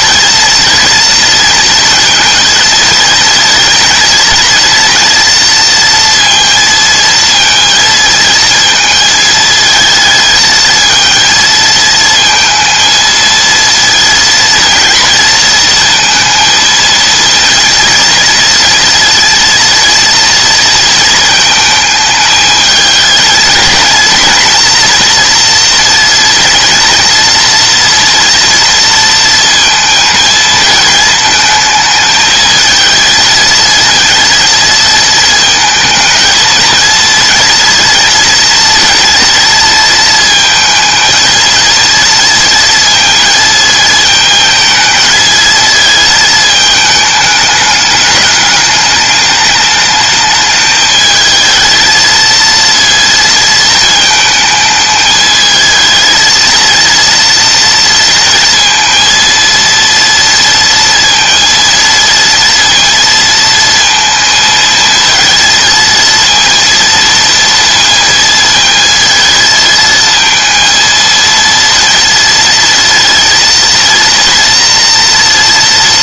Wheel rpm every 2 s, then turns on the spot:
230, 220, 230, 230, 220, 230, 230, 230, 230, 230, 230, 220, 240, 230, 230, 230, 220, 220, 220, 230, 220, 230, 220, 220, 210, 220, 230, 220, 230, 230, 230, 230, 230, 230, 220, 230, 230, 240.
none